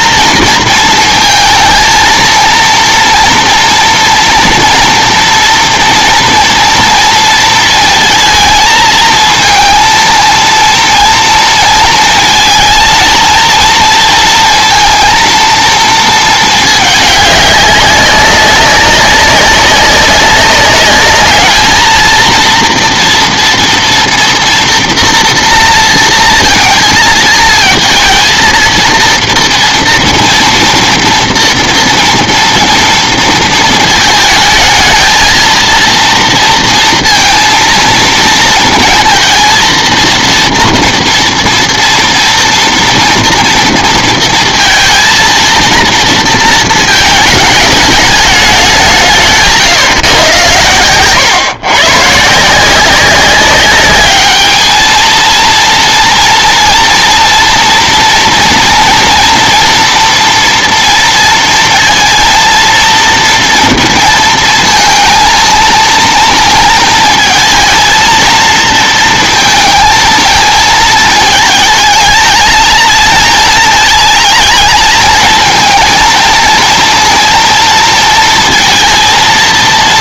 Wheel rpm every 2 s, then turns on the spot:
230, 230, 240, 230, 220, 230, 220, 230, 220, 200, 200, 230, 230, 230, 230, 230, 230, 220, 230, 230, 230, 230, 230, 220, 200, 120, 160, 210, 230, 230, 230, 230, 230, 230, 230, 220, 220, 220, 230, 230.
none